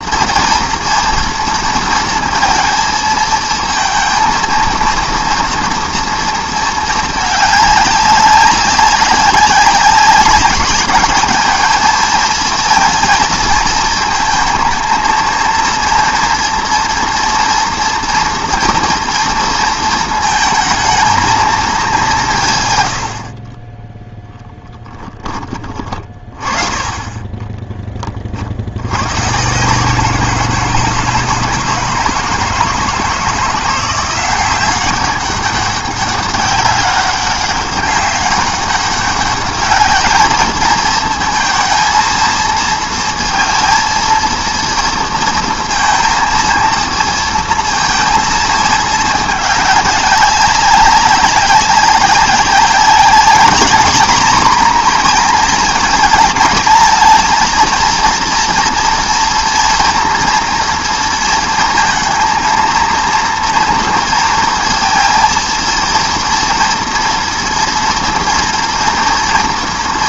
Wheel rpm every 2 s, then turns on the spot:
230, 230, 230, 220, 200, 200, 230, 230, 230, 230, 220, 120, 10, 20, 90, 160, 160, 190, 200, 200, 220, 230, 230, 220, 210, 190, 200, 240, 220, 230, 230, 230, 230, 230, 230.
24-26